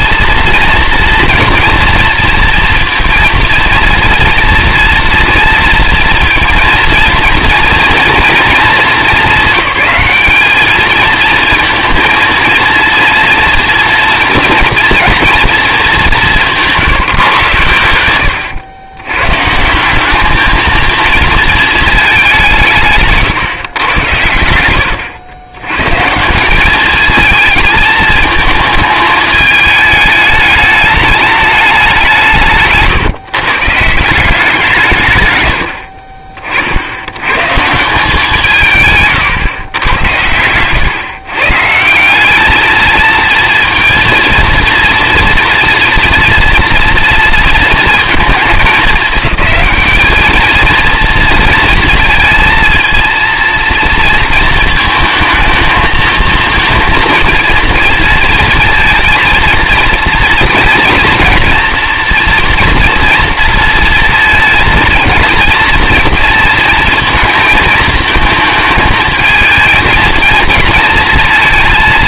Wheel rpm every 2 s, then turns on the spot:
230, 230, 230, 230, 230, 220, 230, 230, 170, 100, 220, 170, 90, 200, 220, 210, 120, 170, 60, 140, 110, 210, 230, 230, 220, 220, 230, 230, 230, 230, 230, 230, 230, 230, 220, 230.
none